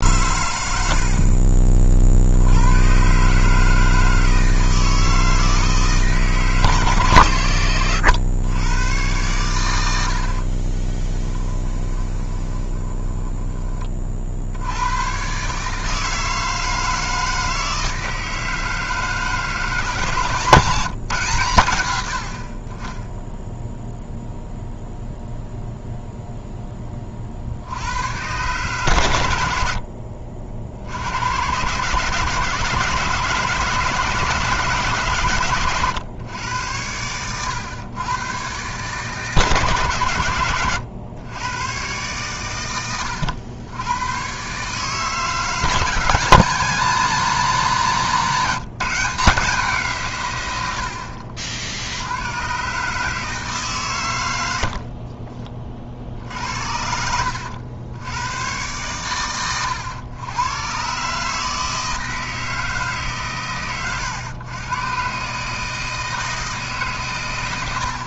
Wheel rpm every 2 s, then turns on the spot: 90, 110, 160, 150, 110, 30, 20, 90, 160, 160, 160, 30, 0, 10, 120, 70, 150, 150, 100, 140, 110, 110, 140, 180, 170, 90, 130, 60, 70, 110, 120, 160, 120, 150.
10-14 54-56